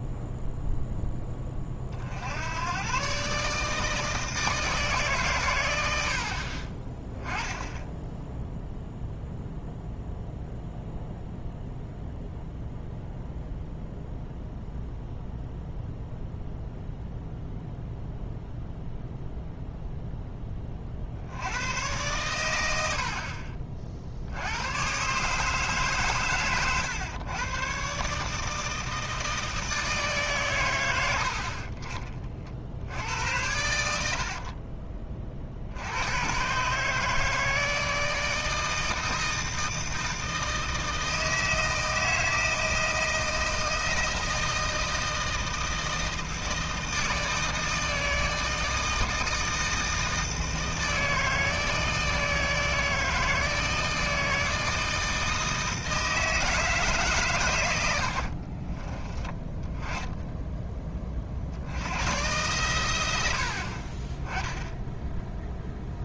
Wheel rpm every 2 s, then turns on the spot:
0, 100, 160, 30, 0, 0, 0, 0, 0, 0, 30, 90, 100, 120, 160, 110, 60, 40, 140, 160, 160, 160, 160, 160, 160, 160, 160, 160, 160, 40, 20, 110, 0.
34-36 58-60